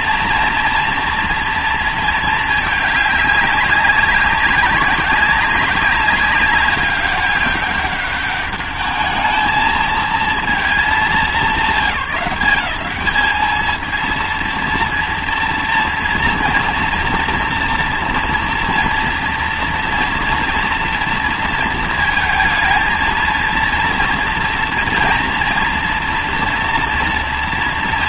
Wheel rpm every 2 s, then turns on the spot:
230, 210, 190, 200, 210, 220, 180, 230, 230, 230, 240, 230, 230, 230.
none